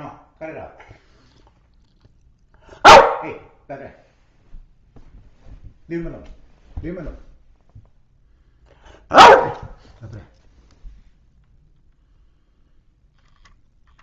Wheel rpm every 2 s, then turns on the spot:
0, 0, 0, 0, 0, 0, 0.
none